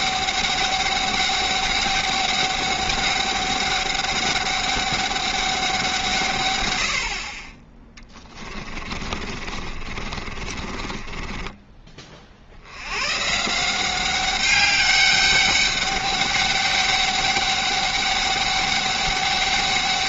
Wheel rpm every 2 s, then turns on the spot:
200, 200, 200, 100, 30, 30, 90, 200, 200, 200.
8-12